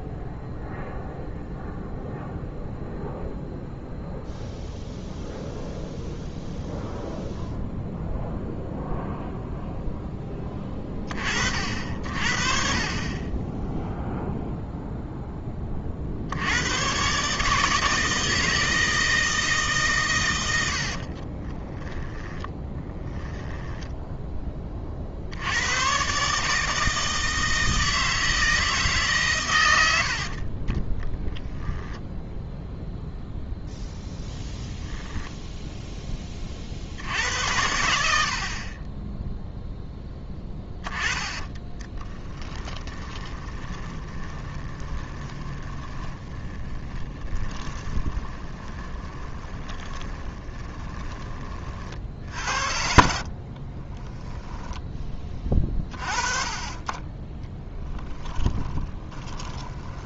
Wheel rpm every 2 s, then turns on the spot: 0, 0, 0, 0, 0, 10, 40, 0, 90, 160, 90, 10, 20, 150, 160, 30, 0, 10, 40, 50, 10, 10, 20, 30, 20, 20, 60, 10, 30, 10.
20-24 34-36 40-54 58-60